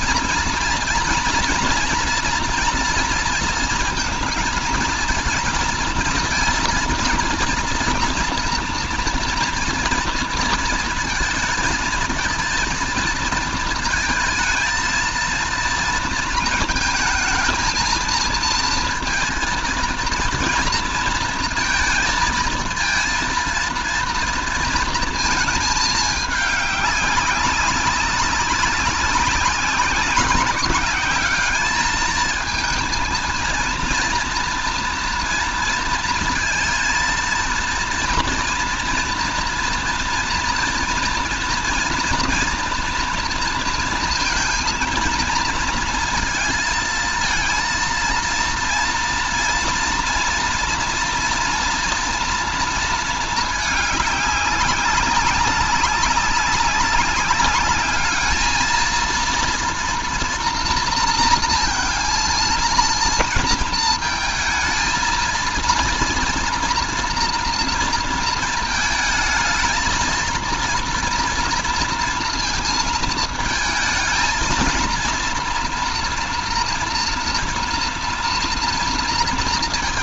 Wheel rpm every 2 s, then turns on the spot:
230, 230, 230, 230, 230, 230, 230, 230, 220, 230, 230, 230, 230, 200, 190, 190, 230, 230, 230, 230, 230, 230, 220, 230, 230, 240, 230, 190, 190, 220, 230, 230, 230, 240, 230, 230, 230, 230, 240, 230.
none